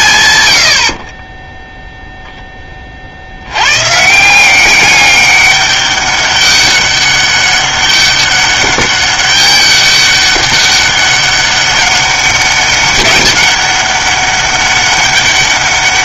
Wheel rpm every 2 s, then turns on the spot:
90, 20, 190, 200, 200, 200, 200, 200.
none